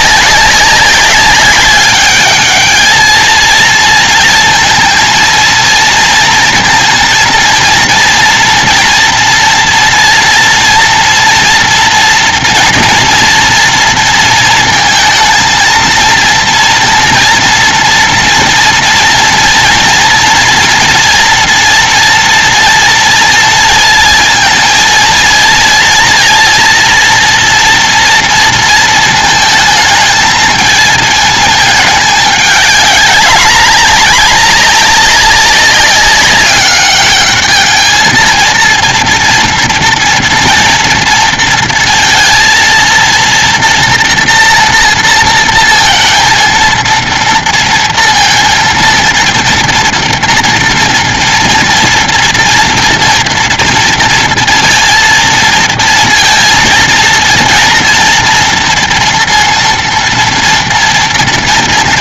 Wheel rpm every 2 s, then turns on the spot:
190, 200, 230, 230, 230, 230, 230, 230, 230, 230, 240, 230, 230, 230, 230, 220, 210, 210, 200, 220, 230, 230, 240, 230, 230, 230, 230, 230, 230, 230, 230.
none